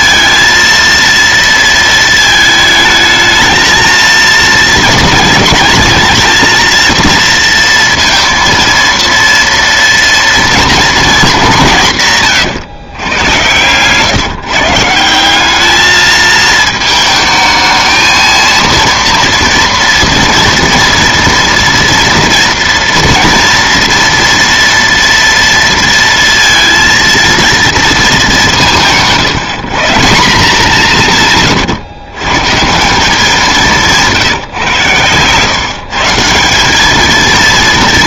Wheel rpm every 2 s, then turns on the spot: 230, 220, 230, 230, 230, 230, 130, 150, 220, 230, 230, 230, 230, 230, 170, 180, 150, 140, 190.
none